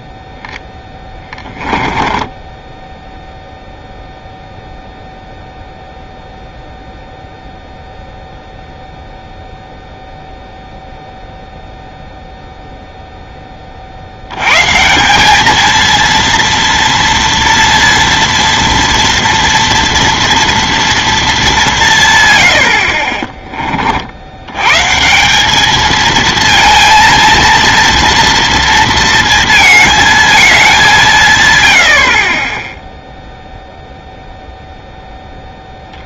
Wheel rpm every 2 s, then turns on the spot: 10, 10, 0, 0, 0, 0, 0, 130, 230, 230, 230, 70, 120, 230, 230, 200, 10, 0.
0-4